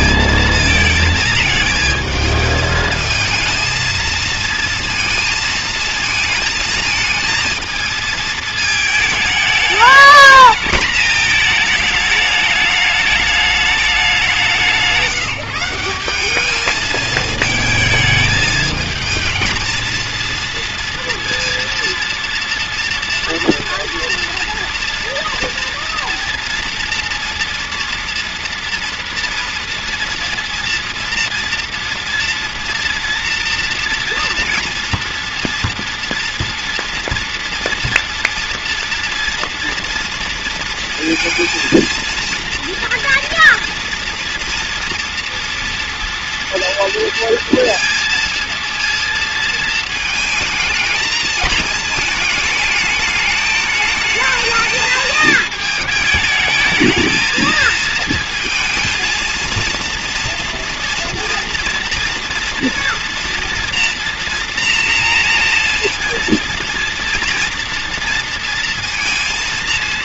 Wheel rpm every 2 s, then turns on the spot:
220, 220, 230, 220, 220, 220, 210, 180, 210, 220, 230, 230, 240, 240, 240, 230, 230, 230, 230, 230, 230, 230, 230, 230, 230, 220, 220, 220, 220, 220, 230, 230, 240, 230, 230.
none